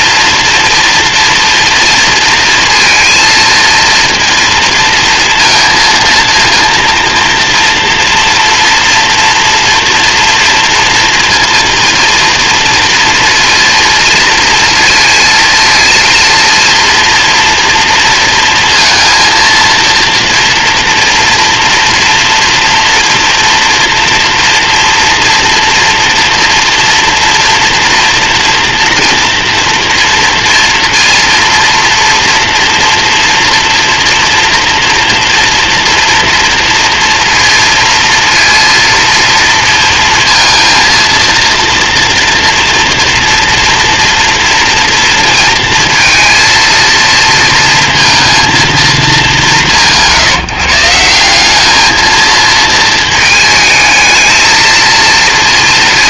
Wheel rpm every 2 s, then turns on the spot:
230, 230, 230, 230, 230, 230, 230, 230, 230, 230, 230, 230, 230, 230, 230, 230, 230, 230, 230, 230, 230, 240, 230, 230, 210, 170, 220, 230.
none